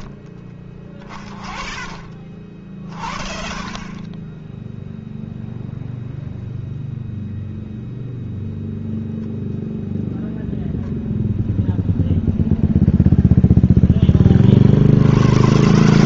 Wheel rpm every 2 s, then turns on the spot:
20, 50, 0, 0, 0, 0, 0, 60.
none